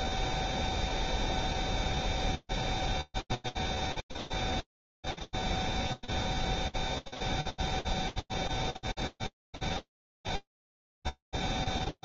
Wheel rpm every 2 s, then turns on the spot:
0, 0, 0, 0, 0, 0.
none